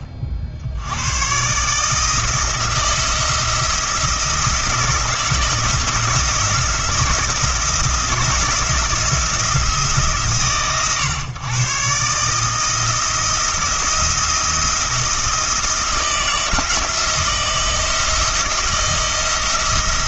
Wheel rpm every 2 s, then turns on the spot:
70, 170, 160, 170, 170, 130, 160, 160, 170, 170.
none